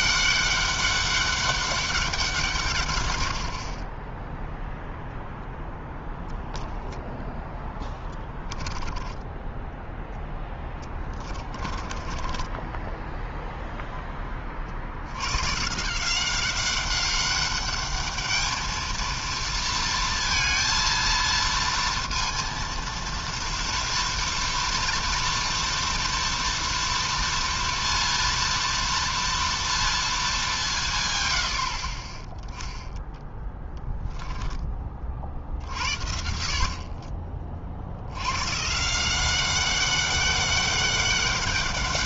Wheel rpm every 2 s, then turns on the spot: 200, 80, 0, 0, 10, 20, 0, 120, 200, 230, 230, 230, 230, 230, 230, 90, 20, 50, 30, 190, 200.
10-12 30-34